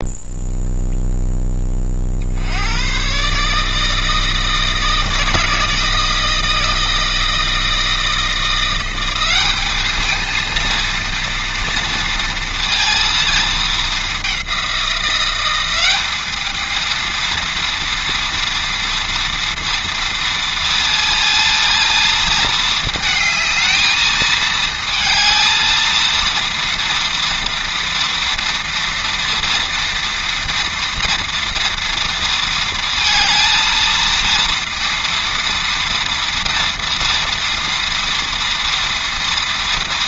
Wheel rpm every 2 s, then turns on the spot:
0, 60, 160, 160, 170, 220, 230, 200, 210, 230, 230, 220, 220, 230, 230, 230, 230, 230, 230, 230.
none